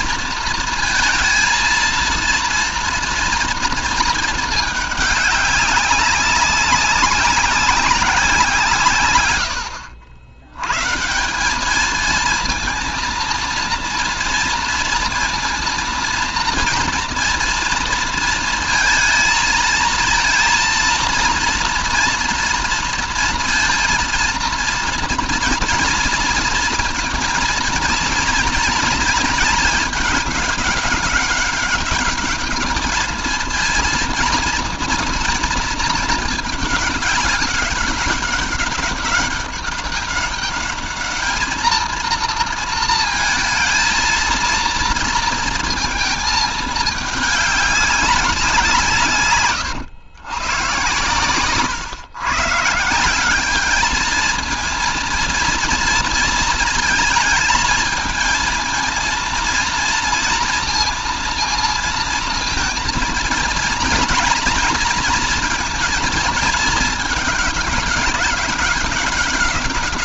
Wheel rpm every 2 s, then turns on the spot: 230, 230, 210, 200, 120, 150, 230, 230, 230, 230, 230, 230, 230, 230, 230, 200, 210, 230, 200, 200, 210, 230, 230, 210, 150, 120, 180, 230, 220, 230, 230, 230, 230, 210, 190.
none